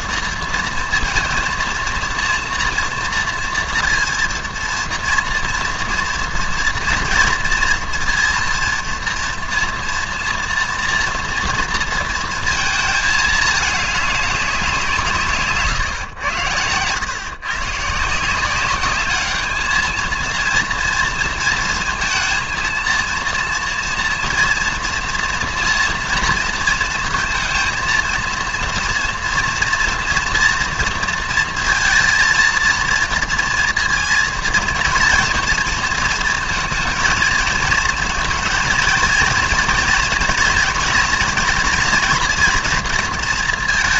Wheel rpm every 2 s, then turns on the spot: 230, 230, 230, 230, 230, 230, 220, 180, 110, 190, 230, 230, 230, 230, 230, 230, 230, 230, 230, 230, 230, 230.
16-18